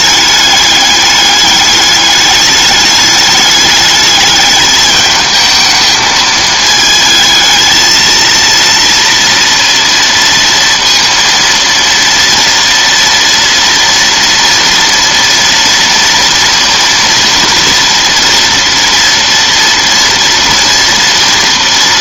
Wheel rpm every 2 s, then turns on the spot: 210, 210, 210, 220, 230, 230, 230, 230, 230, 230, 230.
none